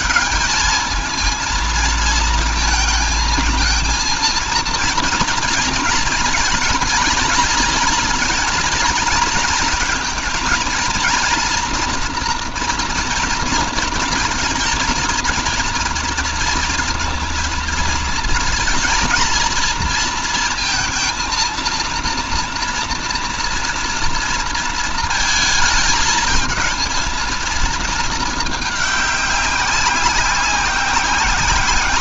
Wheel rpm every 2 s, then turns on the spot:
220, 230, 230, 220, 230, 230, 230, 230, 230, 230, 230, 230, 230, 220, 220, 190.
none